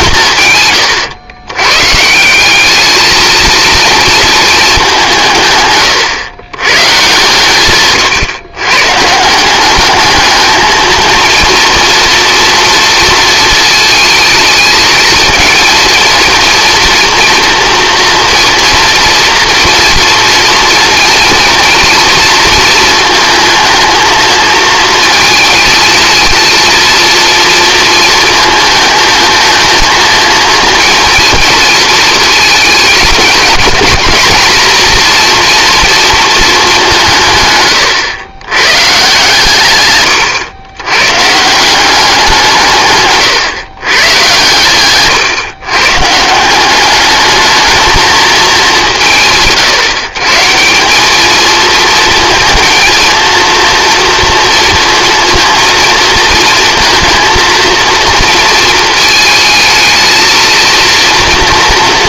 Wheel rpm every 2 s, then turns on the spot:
110, 200, 210, 130, 130, 220, 230, 220, 230, 230, 230, 230, 230, 230, 220, 230, 230, 230, 210, 130, 110, 160, 120, 190, 210, 170, 230, 230, 230, 230, 230.
none